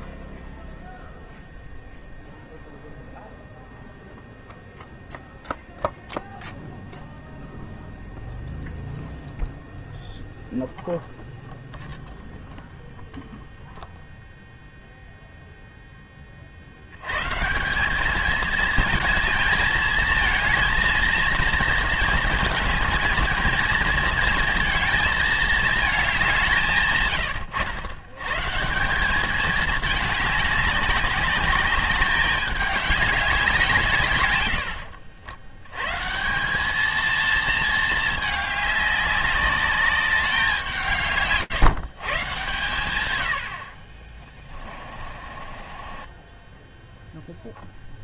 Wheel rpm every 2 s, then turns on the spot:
0, 0, 0, 0, 0, 0, 0, 0, 130, 220, 230, 220, 220, 110, 200, 200, 200, 70, 230, 200, 170, 80, 40, 0.
44-46